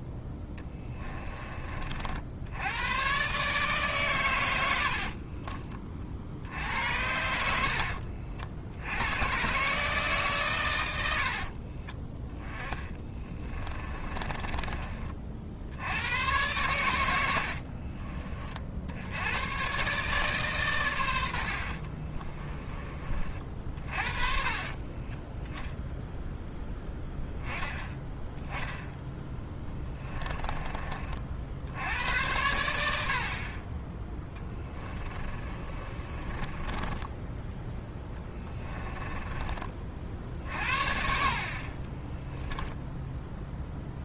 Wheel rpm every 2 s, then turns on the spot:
10, 90, 90, 70, 80, 110, 10, 30, 100, 60, 120, 30, 40, 10, 10, 30, 80, 20, 20, 10, 60, 10.
0-2 4-6 12-14 24-26 34-44